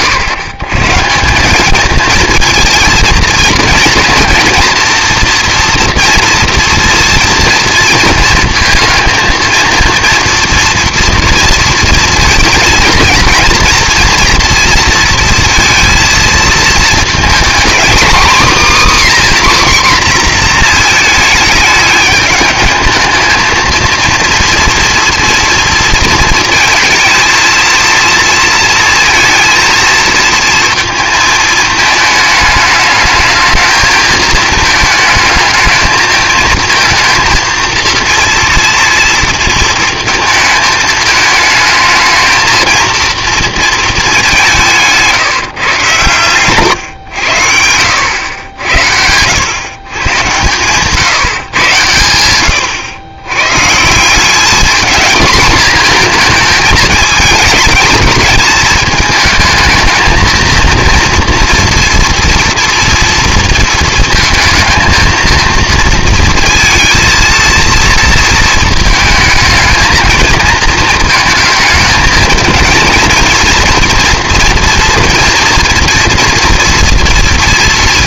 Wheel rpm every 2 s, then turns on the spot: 130, 230, 230, 230, 230, 230, 230, 230, 220, 280, 230, 220, 230, 230, 230, 230, 210, 220, 220, 230, 220, 230, 170, 110, 80, 130, 100, 210, 220, 220, 230, 230, 230, 230, 220, 230, 230, 240, 240.
44-46